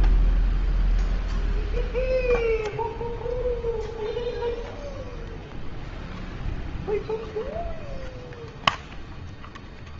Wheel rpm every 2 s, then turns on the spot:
0, 0, 0, 0, 0.
none